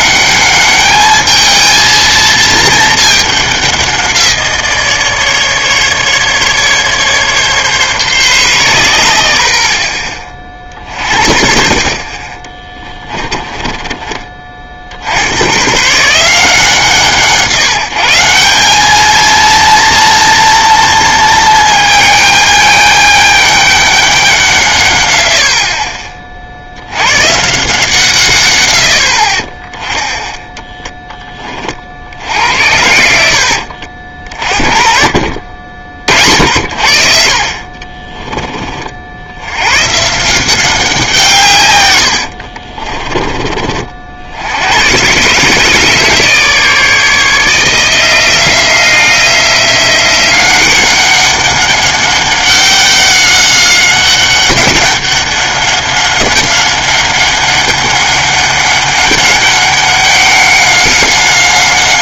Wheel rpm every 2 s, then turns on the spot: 210, 220, 170, 150, 110, 40, 20, 40, 160, 180, 230, 210, 160, 60, 110, 10, 80, 40, 60, 30, 180, 60, 90, 150, 170, 190, 200, 190, 190, 200, 190.
12-14 42-44